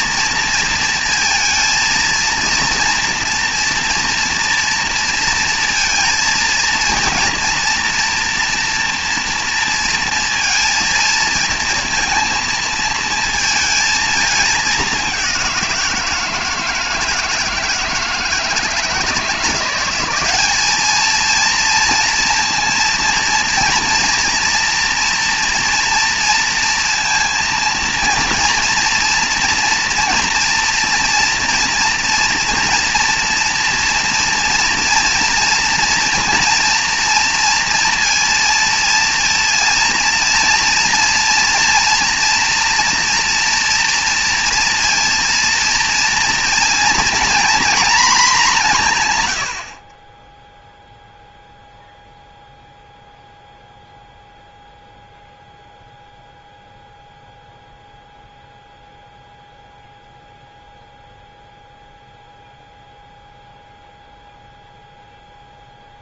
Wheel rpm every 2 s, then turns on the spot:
230, 230, 230, 230, 230, 230, 230, 210, 160, 160, 200, 230, 240, 230, 240, 240, 230, 230, 230, 230, 230, 230, 230, 230, 200, 0, 0, 0, 0, 0, 0, 0, 0.
none